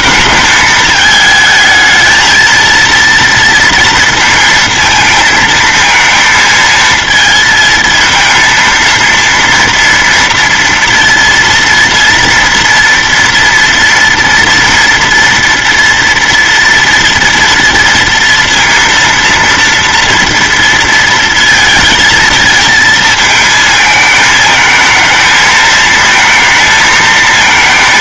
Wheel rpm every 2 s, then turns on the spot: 220, 230, 230, 230, 230, 230, 240, 230, 230, 230, 230, 220, 220, 220.
none